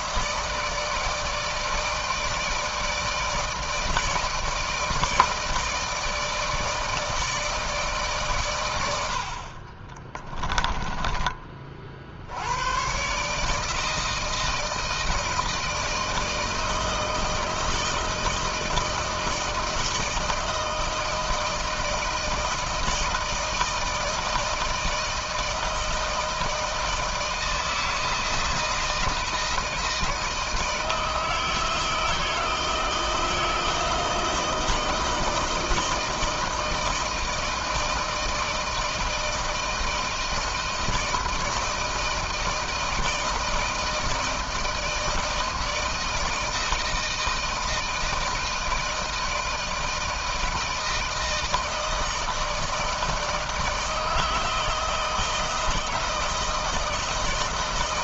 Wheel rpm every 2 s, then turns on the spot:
160, 160, 160, 160, 80, 20, 120, 170, 160, 160, 160, 160, 160, 160, 160, 160, 160, 160, 160, 160, 160, 160, 160, 160, 160, 160, 160, 160, 160.
10-12